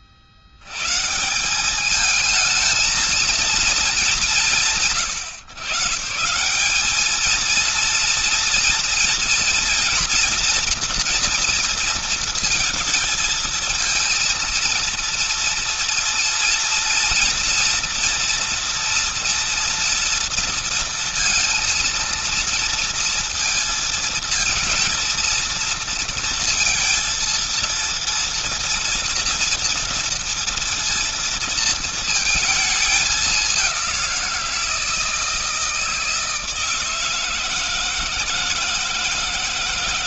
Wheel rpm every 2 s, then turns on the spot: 70, 220, 120, 190, 230, 240, 230, 230, 230, 240, 230, 230, 230, 230, 230, 230, 220, 170, 160, 160.
none